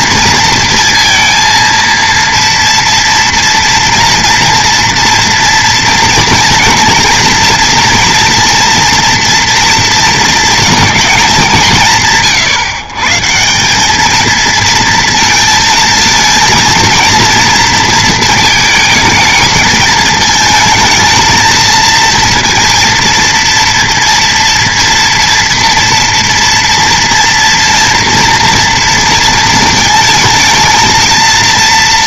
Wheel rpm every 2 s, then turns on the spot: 230, 230, 230, 230, 240, 220, 140, 230, 230, 220, 220, 230, 230, 230, 240, 220.
none